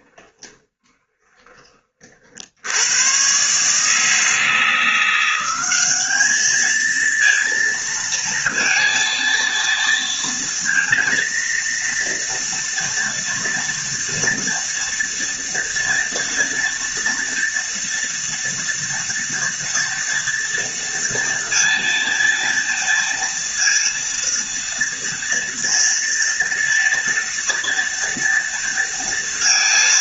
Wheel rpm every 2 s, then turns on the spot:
20, 100, 170, 220, 230, 230, 230, 230, 230, 230, 230, 230, 230, 230, 230.
0-2